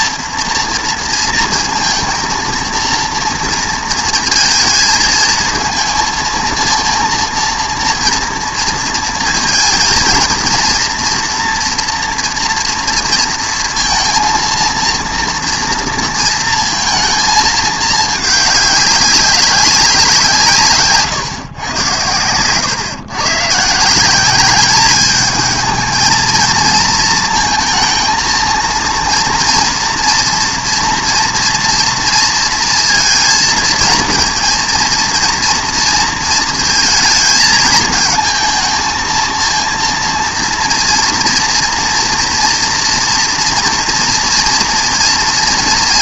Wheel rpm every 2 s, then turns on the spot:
230, 230, 220, 230, 230, 230, 230, 230, 230, 200, 150, 130, 200, 230, 230, 230, 230, 230, 220, 230, 240, 230, 230.
none